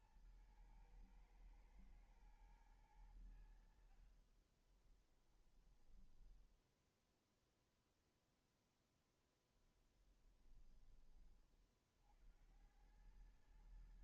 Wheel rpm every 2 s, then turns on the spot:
120, 110, 30, 10, 0, 10, 70.
4-8 10-12